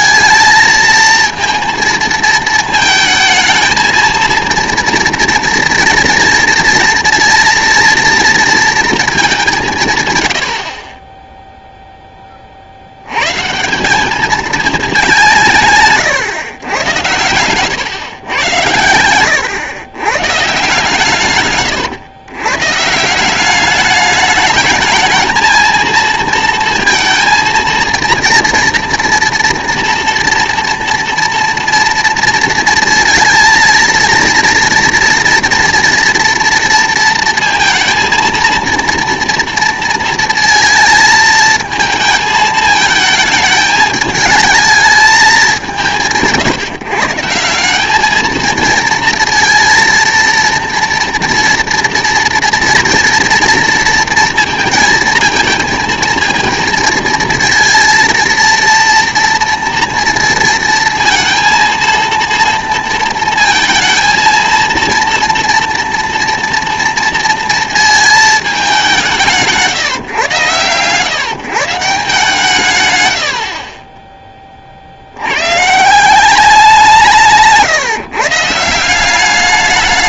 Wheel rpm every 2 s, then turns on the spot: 230, 230, 230, 230, 230, 50, 60, 210, 110, 110, 150, 140, 210, 230, 230, 230, 220, 230, 230, 230, 230, 220, 220, 150, 230, 230, 230, 230, 230, 230, 230, 230, 230, 230, 200, 120, 130, 50, 180, 160.
none